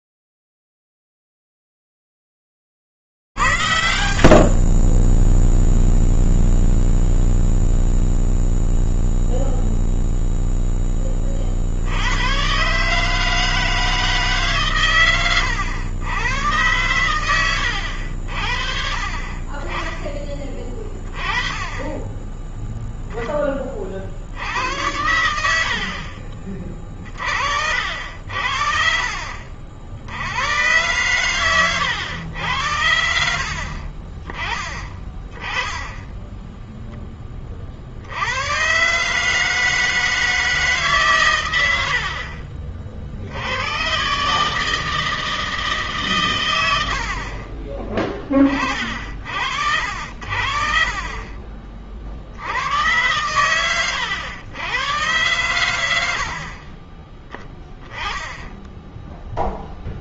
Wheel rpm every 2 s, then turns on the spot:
0, 0, 80, 10, 0, 0, 70, 160, 110, 70, 20, 10, 70, 50, 60, 90, 100, 30, 10, 130, 140, 60, 160, 70, 50, 30, 110, 110, 20, 0.
4-8